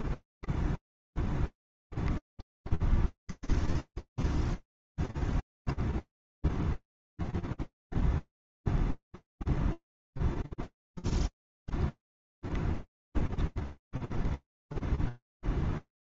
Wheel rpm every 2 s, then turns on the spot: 0, 0, 0, 0, 0, 0, 0, 0.
none